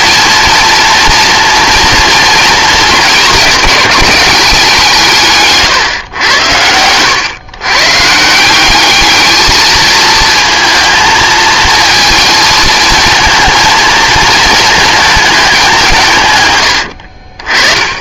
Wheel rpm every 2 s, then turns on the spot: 230, 230, 180, 100, 190, 230, 220, 220, 110.
6-8